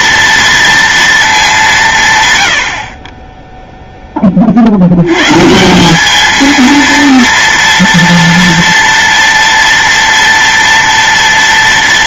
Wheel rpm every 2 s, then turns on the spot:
230, 100, 50, 220, 230, 230.
none